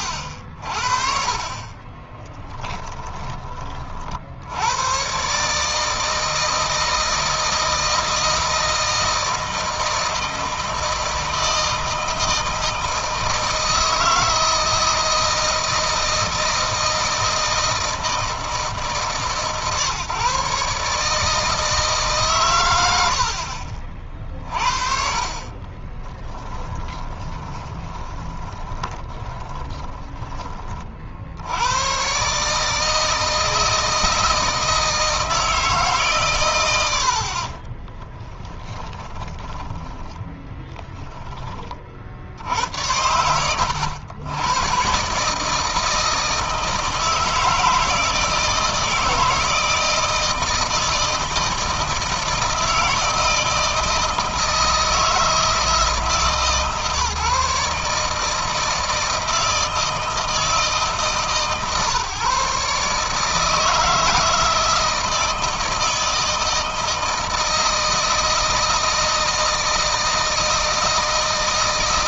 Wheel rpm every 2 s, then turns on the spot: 40, 10, 110, 160, 160, 160, 160, 160, 160, 160, 150, 90, 40, 20, 20, 50, 150, 160, 80, 20, 10, 80, 130, 160, 160, 160, 160, 160, 150, 160, 150, 150, 170, 160, 160, 160.
2-4 26-30 38-40